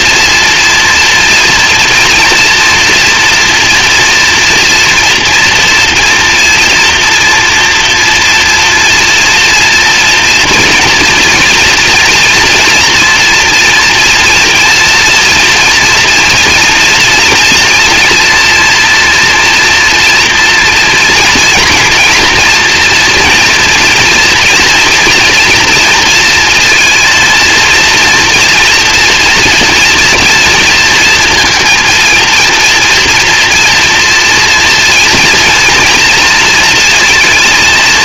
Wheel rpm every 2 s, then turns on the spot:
230, 230, 230, 230, 230, 230, 230, 240, 230, 230, 230, 230, 230, 230, 240, 230, 230, 230, 230.
none